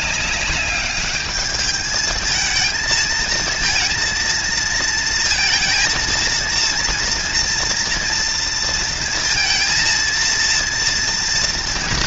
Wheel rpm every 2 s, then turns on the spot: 210, 220, 230, 230, 230, 230.
none